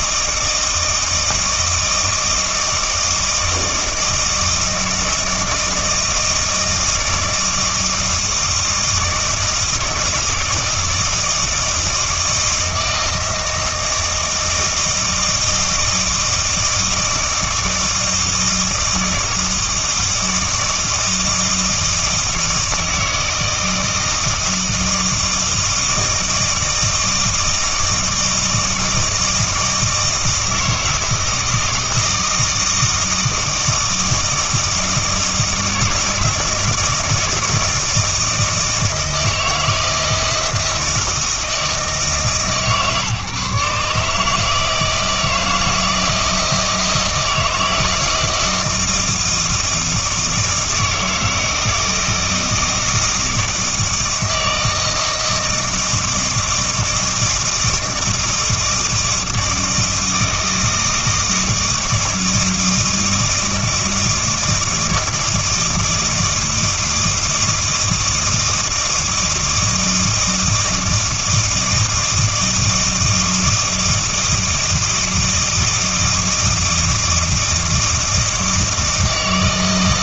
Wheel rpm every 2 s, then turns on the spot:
160, 160, 160, 160, 160, 160, 160, 160, 160, 160, 160, 160, 160, 160, 160, 160, 160, 160, 160, 160, 170, 140, 160, 160, 160, 160, 160, 160, 160, 160, 160, 160, 160, 160, 160, 160, 160, 160, 160, 160.
none